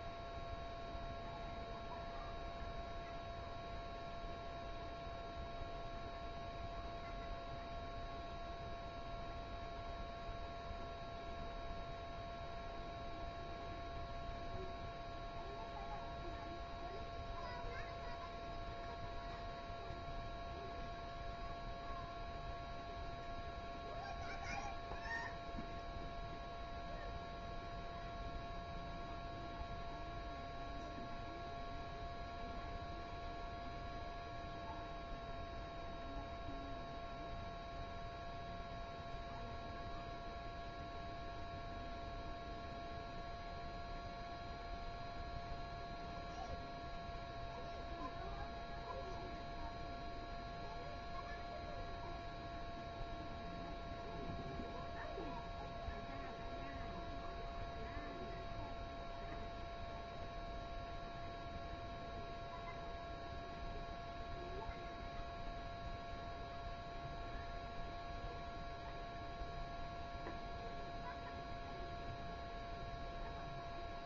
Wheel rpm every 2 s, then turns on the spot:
0, 0, 0, 0, 0, 0, 0, 0, 0, 0, 0, 0, 0, 0, 0, 0, 0, 0, 0, 0, 0, 0, 0, 0, 0, 0, 0, 0, 0, 0, 0, 0, 0, 0, 0, 0, 0.
none